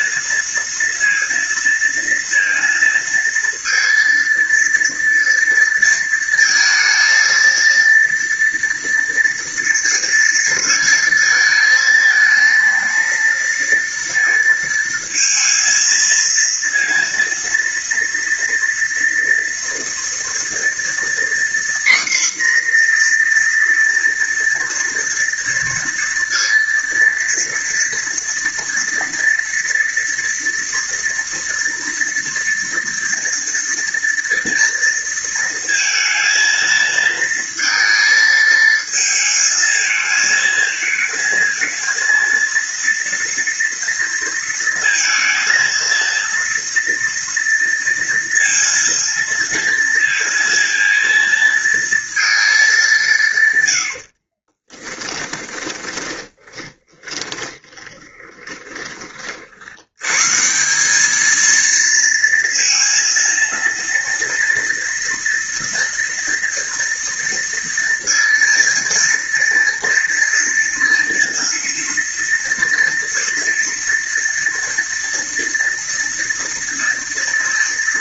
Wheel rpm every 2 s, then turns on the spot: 230, 230, 230, 230, 230, 230, 220, 230, 230, 230, 230, 240, 230, 230, 230, 230, 230, 230, 230, 220, 220, 230, 230, 230, 230, 230, 210, 30, 20, 30, 170, 230, 230, 230, 230, 230, 230, 230, 240.
54-60